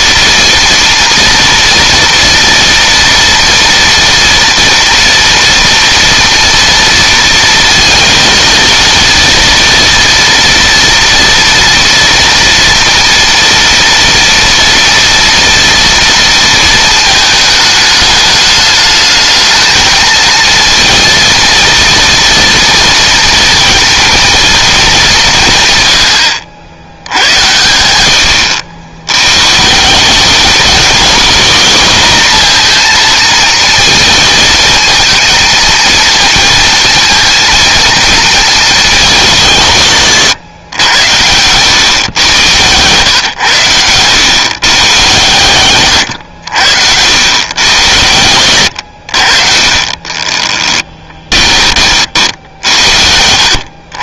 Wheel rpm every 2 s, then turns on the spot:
230, 230, 230, 230, 230, 230, 230, 240, 220, 220, 230, 230, 200, 90, 90, 220, 230, 220, 230, 200, 100, 110, 120, 100, 70, 10, 70.
50-52